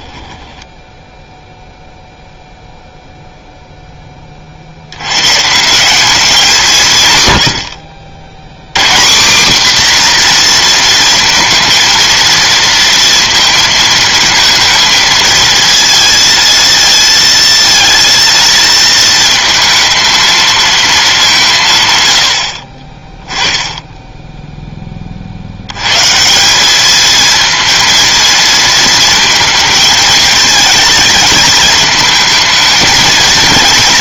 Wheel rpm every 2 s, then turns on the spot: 10, 0, 90, 130, 200, 230, 230, 220, 230, 220, 200, 10, 50, 220, 220, 220, 230.
none